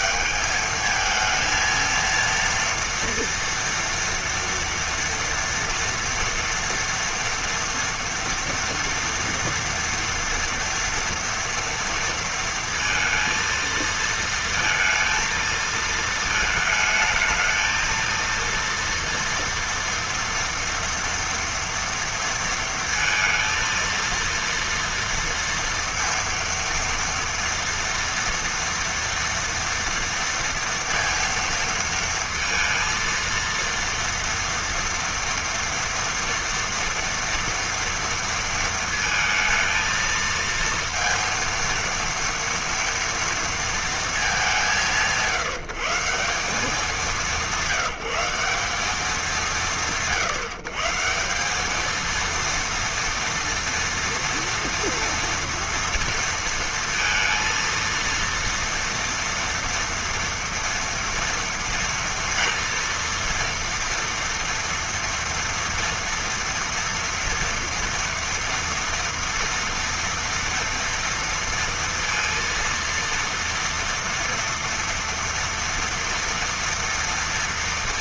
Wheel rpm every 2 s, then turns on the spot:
220, 230, 230, 230, 230, 230, 230, 230, 220, 230, 230, 230, 230, 230, 230, 230, 230, 230, 230, 220, 230, 230, 170, 190, 190, 150, 230, 230, 230, 230, 230, 230, 230, 230, 230, 230, 230, 230, 230.
none